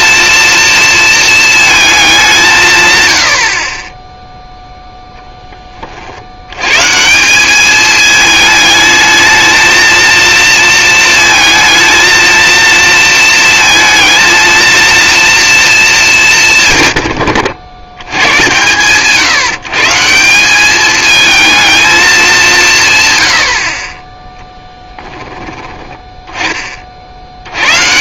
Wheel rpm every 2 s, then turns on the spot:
230, 170, 0, 100, 220, 230, 230, 230, 150, 130, 190, 190, 10, 20.
none